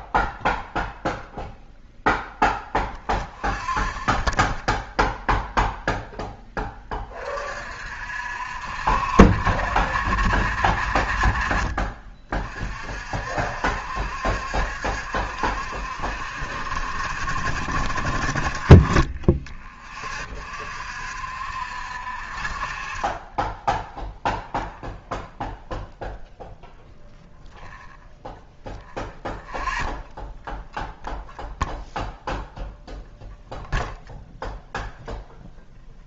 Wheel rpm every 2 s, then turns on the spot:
0, 0, 0, 20, 60, 50, 40, 70, 60, 30, 50, 30, 0, 0, 0, 0, 0, 0.
none